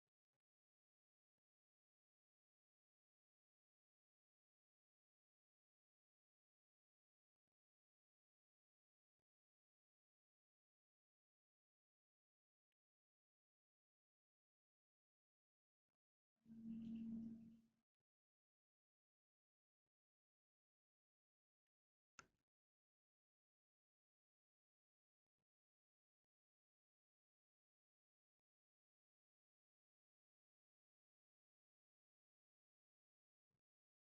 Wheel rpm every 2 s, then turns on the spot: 0, 0, 0, 0, 0, 0, 0, 0, 0, 0, 0, 0, 0, 0, 0, 0, 0.
none